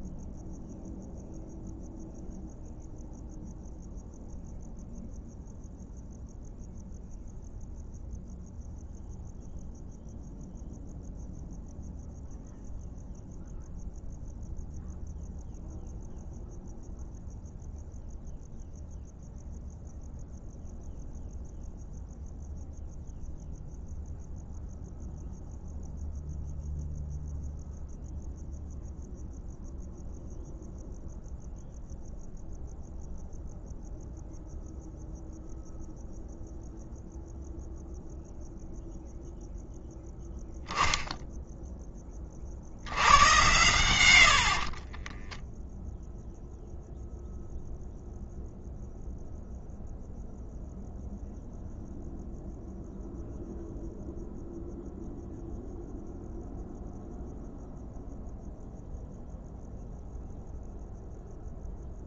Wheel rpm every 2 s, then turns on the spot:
0, 0, 0, 0, 0, 0, 0, 0, 0, 0, 0, 0, 0, 0, 0, 0, 0, 0, 0, 0, 10, 80, 30, 0, 0, 0, 0, 0, 0, 0, 0.
44-46